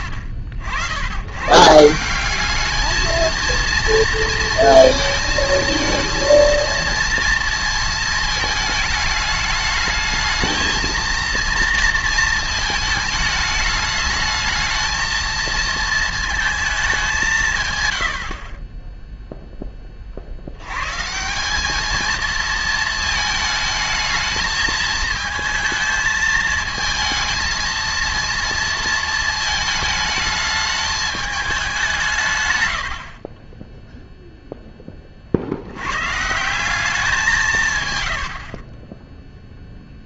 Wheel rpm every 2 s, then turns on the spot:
80, 210, 230, 230, 210, 220, 220, 220, 210, 20, 120, 220, 220, 220, 230, 210, 80, 20, 190, 30.
32-34